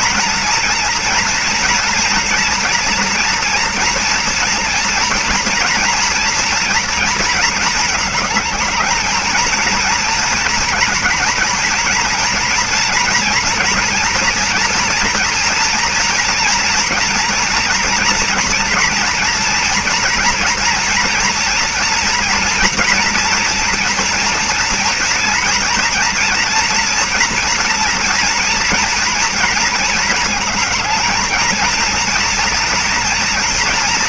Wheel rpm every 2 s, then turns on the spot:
230, 230, 230, 230, 220, 230, 240, 230, 240, 230, 240, 230, 230, 230, 230, 220, 230.
none